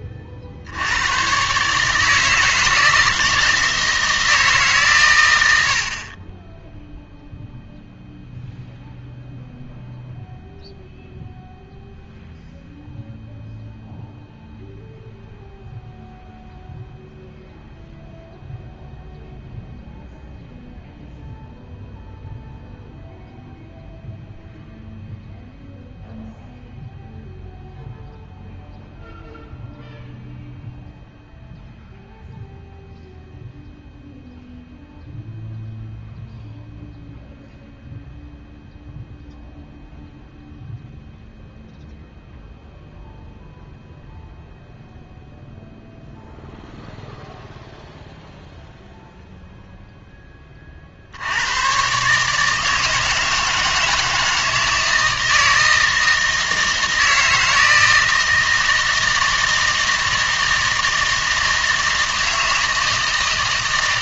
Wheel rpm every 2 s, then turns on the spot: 60, 160, 150, 10, 0, 0, 0, 0, 0, 0, 0, 0, 0, 0, 0, 0, 0, 0, 0, 0, 0, 0, 0, 0, 0, 30, 160, 160, 160, 160, 160, 160.
none